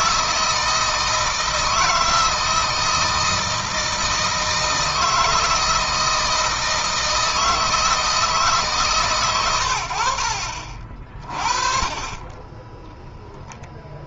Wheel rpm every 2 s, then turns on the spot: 160, 160, 160, 160, 140, 40, 10.
none